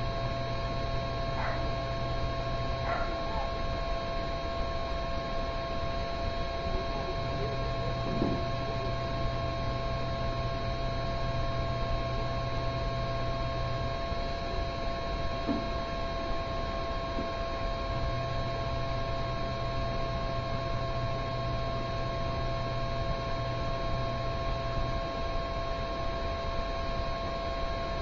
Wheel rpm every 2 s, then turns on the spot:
0, 0, 0, 0, 0, 0, 0, 0, 0, 0, 0, 0, 0, 0.
none